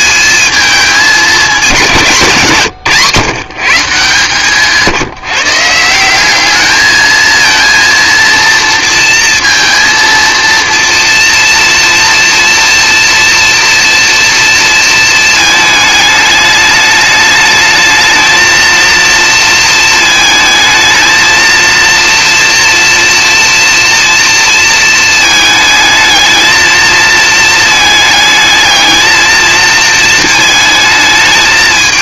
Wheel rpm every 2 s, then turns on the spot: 210, 150, 160, 210, 230, 230, 240, 230, 210, 230, 220, 240, 230, 220, 220, 220.
none